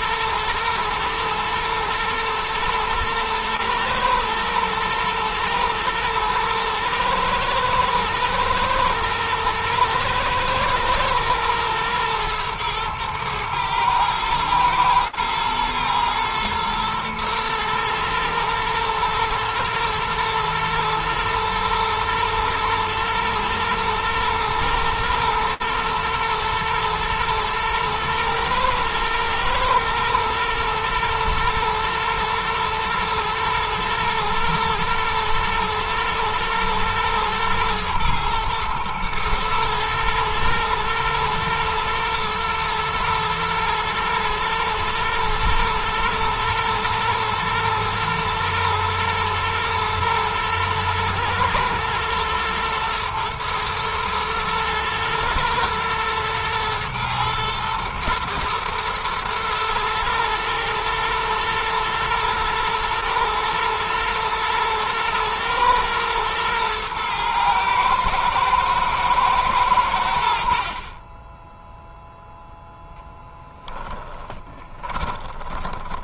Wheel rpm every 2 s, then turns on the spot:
110, 120, 110, 110, 120, 120, 110, 110, 110, 110, 110, 110, 110, 110, 110, 110, 120, 120, 120, 110, 110, 120, 120, 110, 110, 110, 120, 110, 110, 120, 120, 120, 110, 120, 110, 40, 0, 20.
74-76